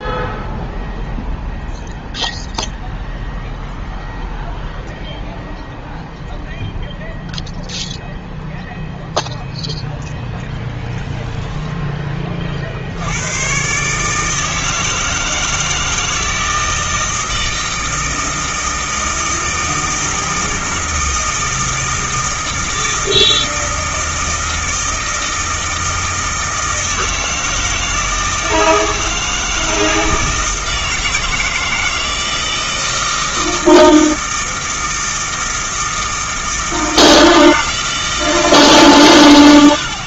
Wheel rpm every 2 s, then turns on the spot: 0, 0, 0, 0, 0, 10, 50, 160, 160, 160, 160, 160, 160, 160, 160, 160, 160, 160, 160, 150.
10-12